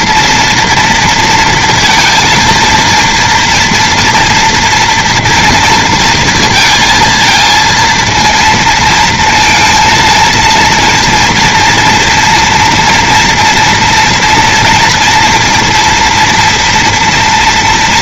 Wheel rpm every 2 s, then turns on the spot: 230, 230, 230, 230, 230, 230, 230, 230, 240.
none